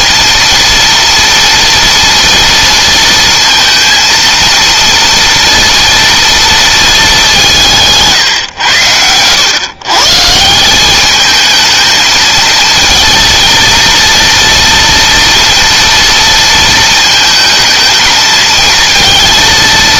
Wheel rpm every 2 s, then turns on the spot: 230, 230, 230, 220, 110, 190, 220, 230, 220, 230.
none